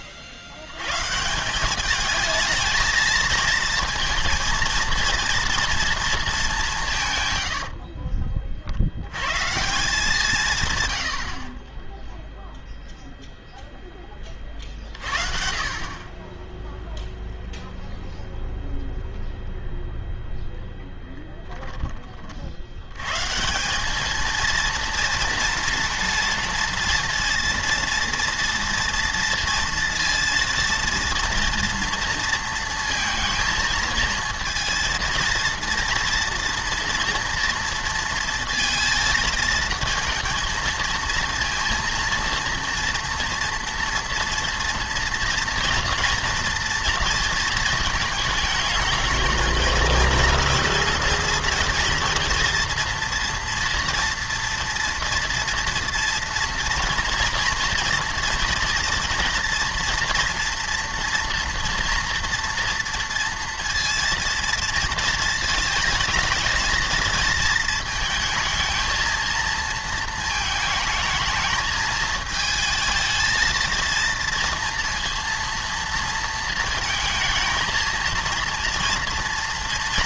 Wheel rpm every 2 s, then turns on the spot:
90, 220, 230, 180, 60, 130, 0, 40, 0, 0, 0, 80, 230, 230, 230, 230, 230, 230, 230, 230, 230, 230, 230, 230, 220, 230, 240, 230, 230, 230, 230, 230, 230, 220, 230, 220, 220, 230, 220, 230.
none